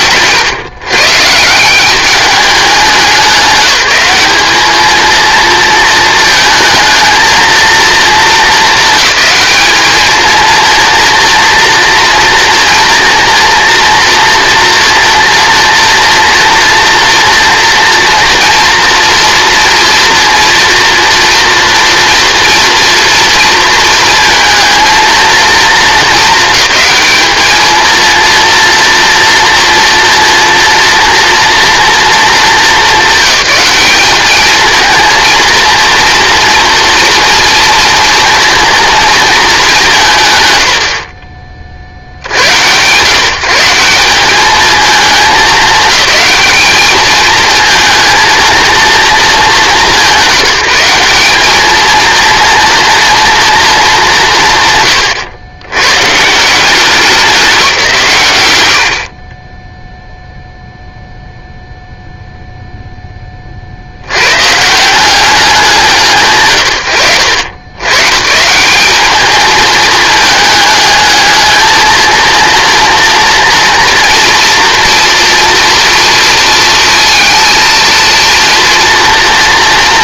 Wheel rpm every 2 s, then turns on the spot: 140, 200, 220, 220, 220, 230, 230, 240, 240, 230, 230, 230, 230, 220, 230, 230, 200, 220, 230, 230, 90, 110, 210, 210, 230, 190, 240, 150, 180, 90, 0, 0, 150, 130, 170, 210, 230, 230, 230, 230.
none